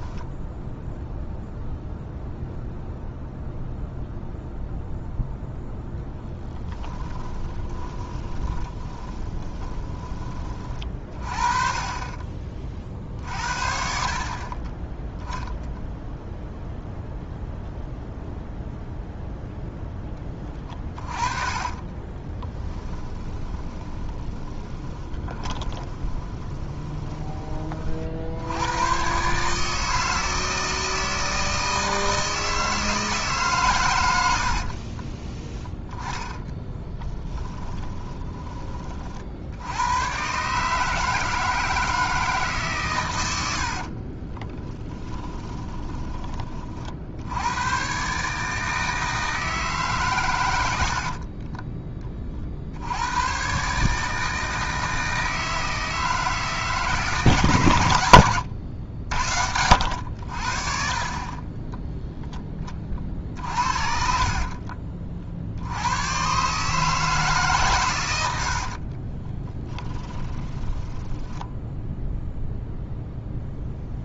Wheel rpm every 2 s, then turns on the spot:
0, 0, 0, 10, 10, 30, 40, 10, 0, 0, 20, 10, 20, 20, 110, 160, 160, 40, 10, 30, 150, 120, 10, 60, 160, 70, 90, 160, 150, 80, 40, 30, 50, 150, 40, 20, 0.
6-10 20-28 34-38 44-46 68-72